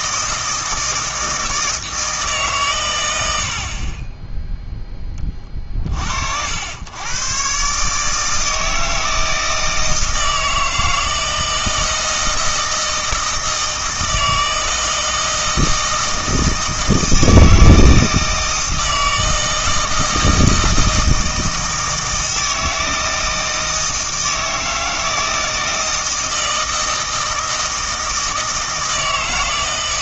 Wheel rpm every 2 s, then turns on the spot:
160, 130, 0, 90, 160, 160, 160, 160, 160, 160, 160, 160, 160, 160, 160.
none